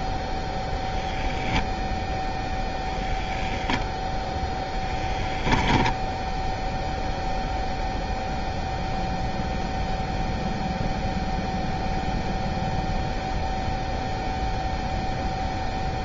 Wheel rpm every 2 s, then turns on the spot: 0, 0, 0, 0, 0, 0, 0, 0.
none